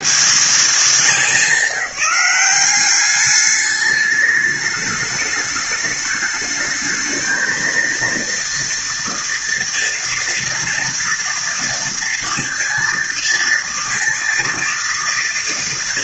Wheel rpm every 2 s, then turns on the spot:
210, 190, 210, 220, 230, 230, 230, 230.
none